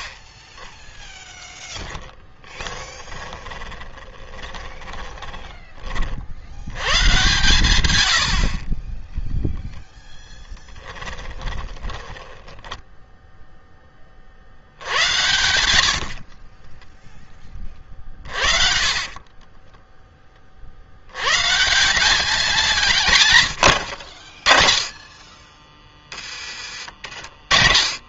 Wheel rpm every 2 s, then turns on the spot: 20, 10, 40, 100, 40, 10, 10, 80, 30, 50, 50, 180, 40, 30.
2-6 8-10 12-14 16-20